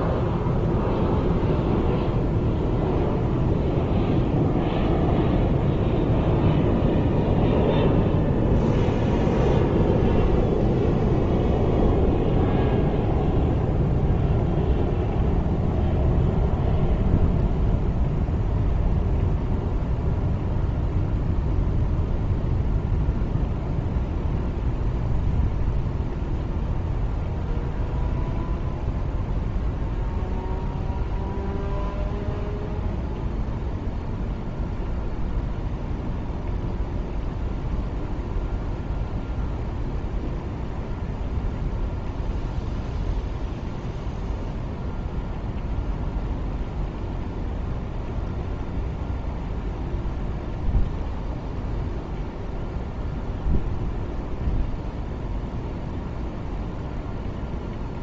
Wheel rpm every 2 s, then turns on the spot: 0, 0, 0, 0, 0, 0, 0, 0, 0, 0, 0, 0, 0, 0, 0, 0, 0, 0, 0, 0, 0, 0, 0, 0, 0, 0, 0, 0, 0.
none